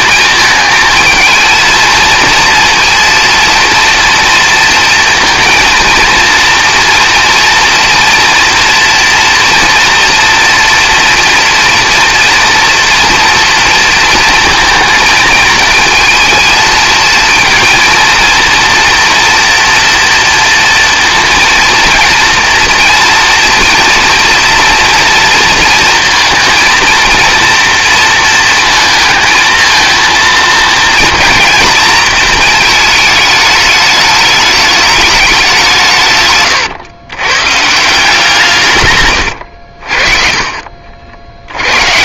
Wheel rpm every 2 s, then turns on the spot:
220, 230, 230, 230, 230, 230, 240, 230, 220, 230, 230, 230, 240, 230, 230, 230, 220, 210, 140, 160, 50.
none